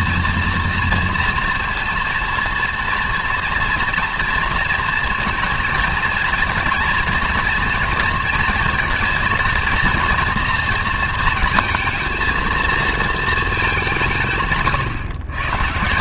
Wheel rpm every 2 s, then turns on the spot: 240, 230, 230, 240, 230, 230, 230, 140.
none